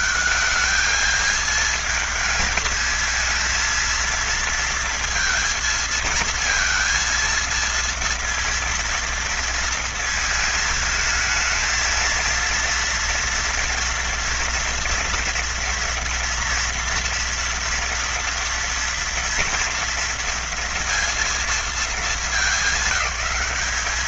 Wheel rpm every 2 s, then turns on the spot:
220, 220, 230, 230, 230, 220, 230, 230, 230, 230, 230, 210.
none